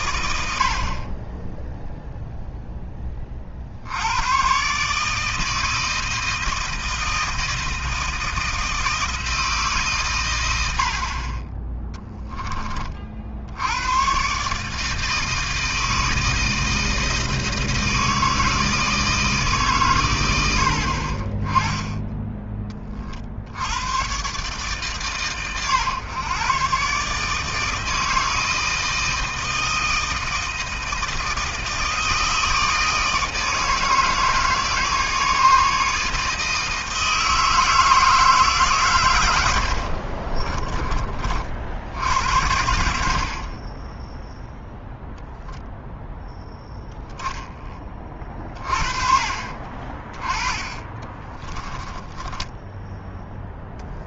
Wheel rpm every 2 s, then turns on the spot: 70, 10, 140, 160, 160, 80, 30, 150, 160, 160, 80, 20, 140, 130, 160, 160, 160, 160, 160, 140, 30, 80, 0, 10, 30, 20, 10.
10-12